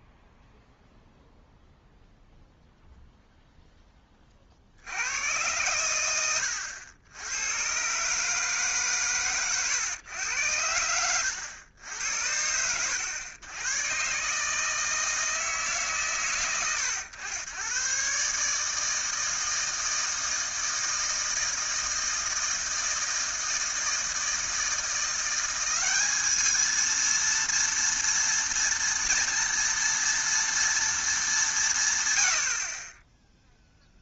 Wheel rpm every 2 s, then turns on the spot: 0, 0, 70, 90, 140, 80, 90, 160, 100, 150, 160, 160, 160, 220, 230, 230, 70.
none